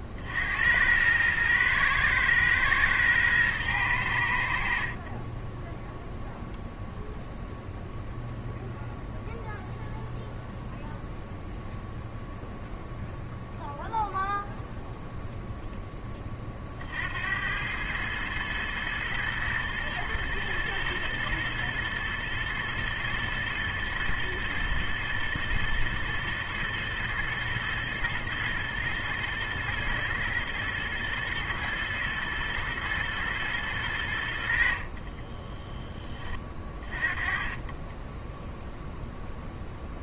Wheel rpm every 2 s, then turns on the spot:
90, 110, 60, 0, 0, 0, 0, 0, 50, 120, 120, 120, 110, 120, 110, 110, 120, 60, 30, 0.
34-36